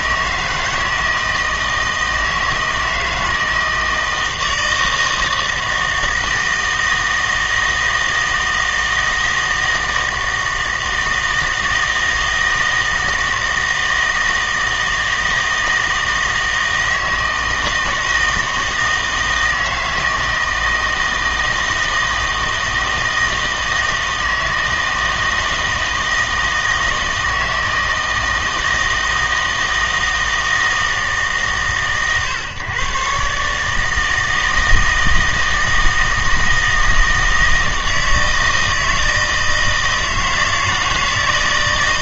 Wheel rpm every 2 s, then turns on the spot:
160, 160, 160, 160, 160, 160, 160, 160, 160, 160, 160, 160, 160, 160, 160, 160, 130, 160, 160, 160, 160.
none